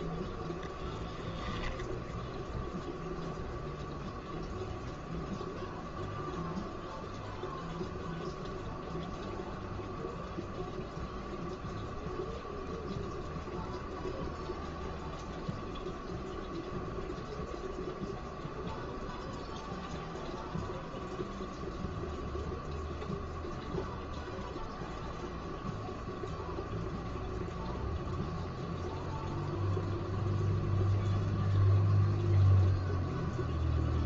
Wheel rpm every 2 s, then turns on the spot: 0, 0, 0, 0, 0, 0, 0, 0, 0, 0, 0, 0, 0, 0, 0, 0, 0.
none